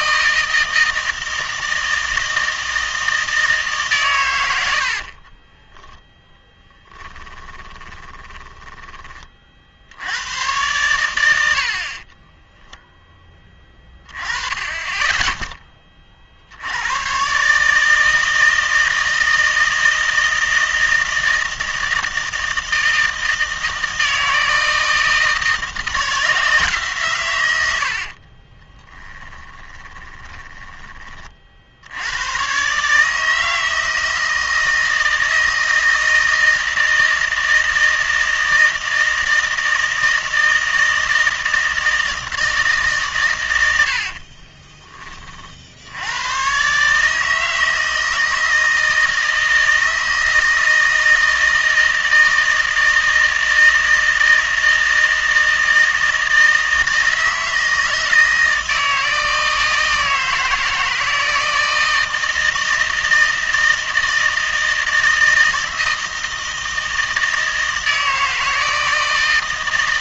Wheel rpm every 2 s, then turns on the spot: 160, 160, 80, 10, 20, 100, 0, 20, 80, 160, 160, 160, 160, 160, 20, 10, 120, 160, 160, 160, 160, 160, 20, 140, 160, 160, 160, 160, 160, 160, 160, 160, 160, 160, 160.
6-10 28-32 44-46